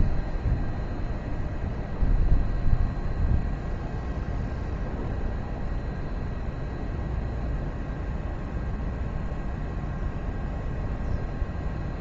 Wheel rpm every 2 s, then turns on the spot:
0, 0, 0, 0, 0, 0.
none